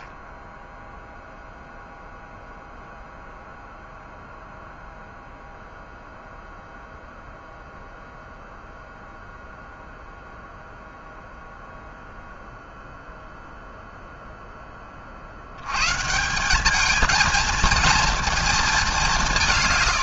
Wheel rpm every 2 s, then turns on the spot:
0, 0, 0, 0, 0, 0, 0, 20, 210, 200.
none